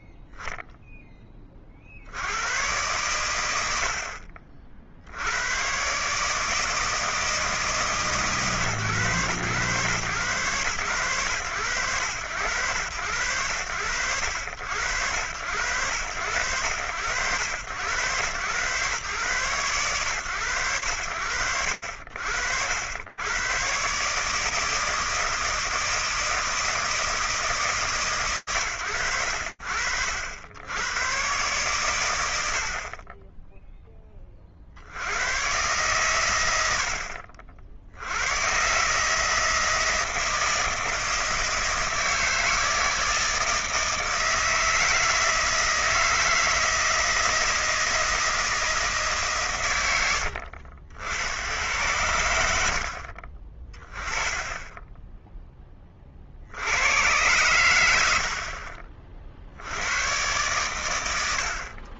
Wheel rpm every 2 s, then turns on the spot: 0, 100, 50, 160, 140, 120, 100, 90, 90, 120, 90, 80, 160, 160, 100, 70, 70, 50, 80, 140, 160, 160, 160, 160, 160, 70, 70, 10, 100, 60, 80.
54-56